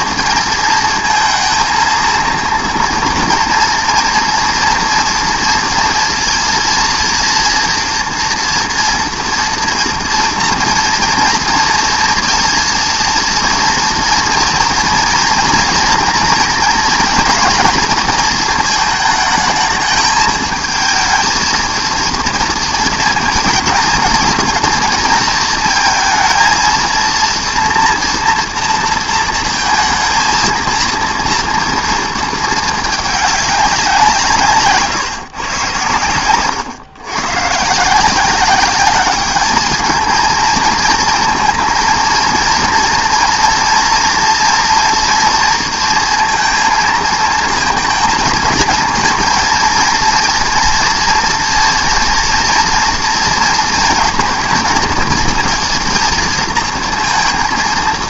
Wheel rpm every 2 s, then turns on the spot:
220, 230, 230, 230, 230, 230, 230, 230, 230, 220, 220, 230, 230, 230, 230, 230, 220, 140, 120, 190, 220, 230, 230, 230, 230, 230, 230, 230, 230.
none